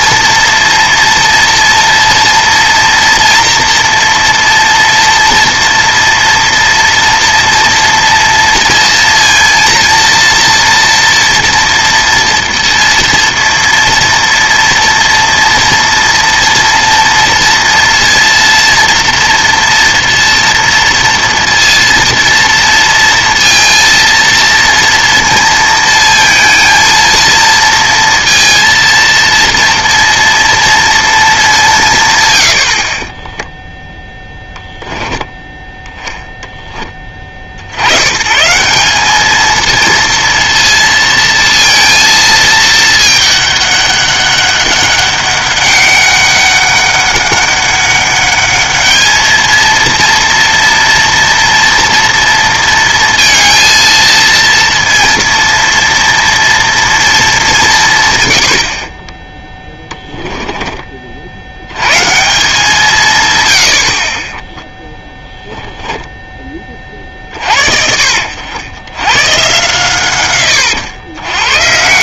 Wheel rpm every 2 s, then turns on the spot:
230, 230, 230, 230, 230, 230, 230, 230, 230, 230, 230, 230, 230, 230, 230, 230, 80, 10, 20, 170, 230, 220, 200, 200, 210, 230, 230, 230, 230, 70, 20, 170, 10, 30, 100, 100.
64-66